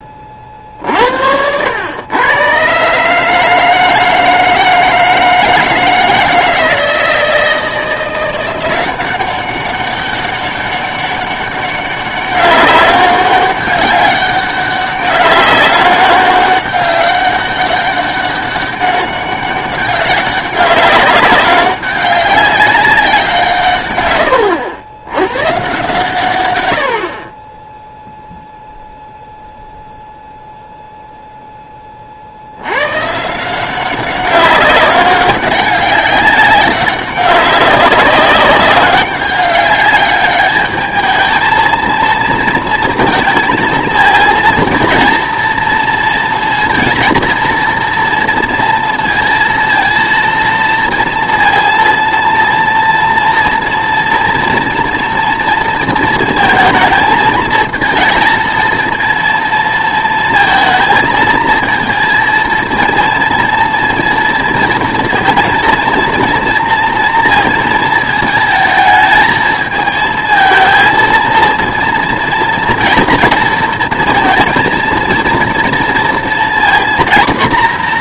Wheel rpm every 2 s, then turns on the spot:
50, 130, 160, 160, 180, 200, 200, 190, 200, 200, 190, 200, 90, 100, 0, 0, 110, 200, 200, 200, 210, 230, 230, 230, 230, 230, 230, 240, 220, 230, 230, 230, 230, 230, 220, 230, 230, 230, 240.
none